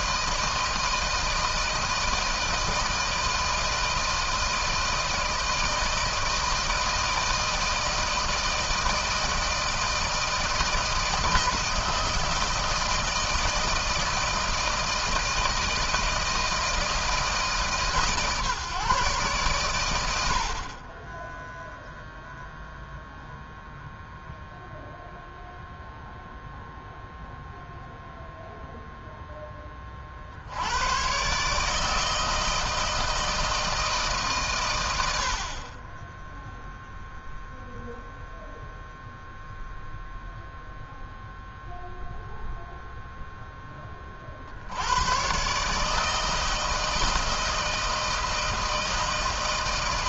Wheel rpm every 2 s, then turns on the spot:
160, 160, 160, 160, 160, 160, 160, 160, 170, 150, 60, 0, 0, 0, 0, 70, 160, 130, 0, 0, 0, 0, 60, 160, 160.
none